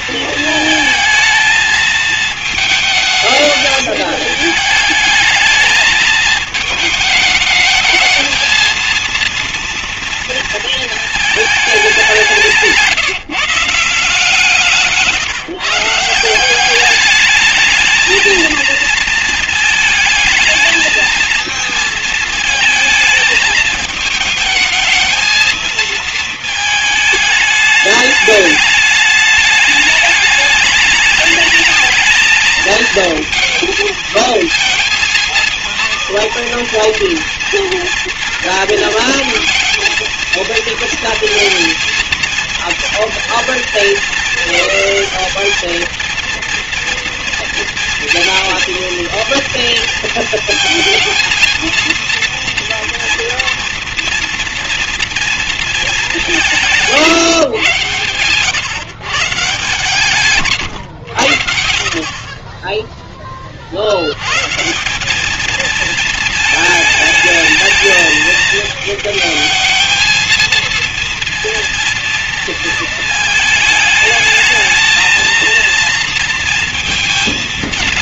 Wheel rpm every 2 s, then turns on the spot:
230, 220, 210, 210, 230, 220, 170, 160, 200, 230, 220, 220, 220, 220, 210, 210, 230, 230, 230, 230, 230, 230, 220, 230, 230, 230, 230, 230, 150, 140, 110, 10, 190, 220, 220, 230, 230, 220, 230.
14-16